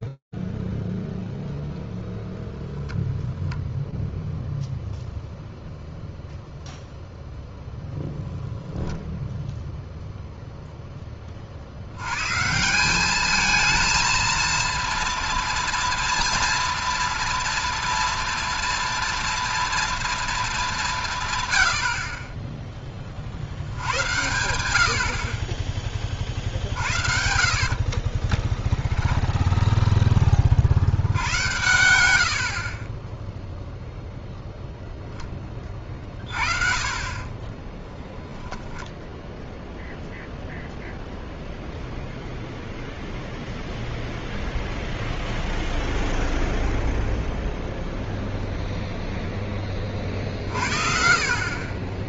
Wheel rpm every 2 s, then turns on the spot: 0, 0, 0, 0, 10, 190, 230, 230, 230, 190, 10, 70, 60, 10, 50, 40, 0, 40, 10, 0, 0, 0, 0, 0, 40, 10.
36-38